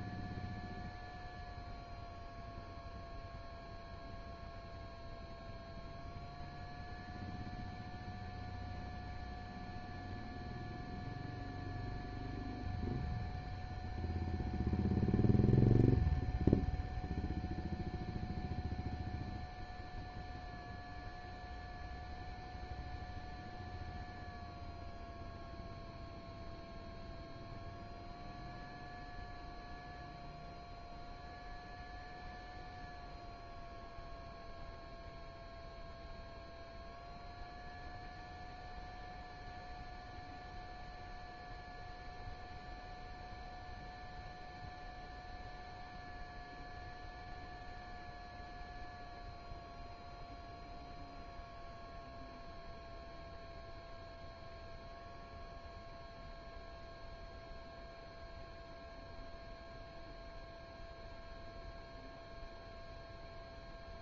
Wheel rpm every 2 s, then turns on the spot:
0, 0, 0, 0, 0, 0, 0, 0, 0, 0, 0, 0, 0, 0, 0, 0, 0, 0, 0, 0, 0, 0, 0, 0, 0, 0, 0, 0, 0, 0, 0, 0.
none